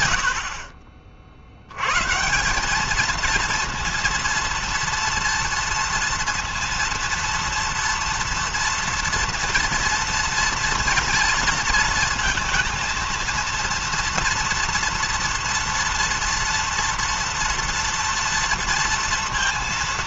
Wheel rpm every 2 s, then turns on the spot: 60, 210, 230, 230, 240, 230, 230, 230, 230, 230.
none